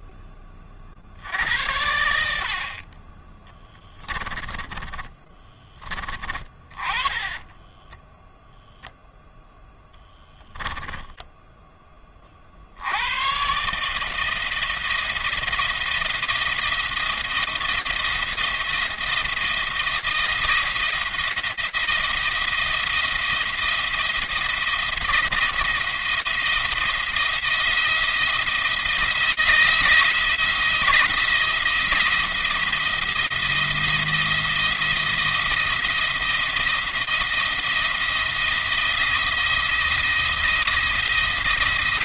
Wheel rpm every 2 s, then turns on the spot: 50, 30, 20, 20, 0, 10, 80, 160, 170, 170, 170, 170, 170, 170, 160, 170, 170, 170, 170, 170, 170.
4-8 10-12